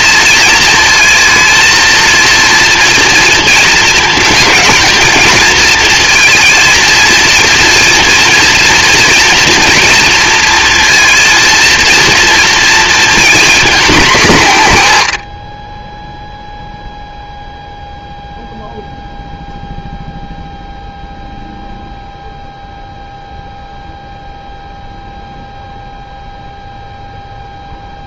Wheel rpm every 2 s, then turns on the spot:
230, 220, 230, 240, 230, 230, 220, 30, 0, 0, 0, 0, 0, 0.
none